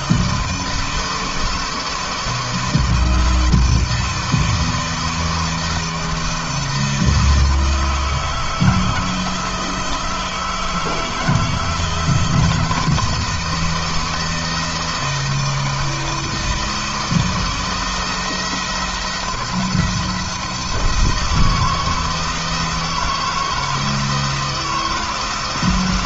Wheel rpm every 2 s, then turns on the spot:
160, 160, 160, 160, 160, 160, 160, 160, 160, 170, 160, 160, 160.
none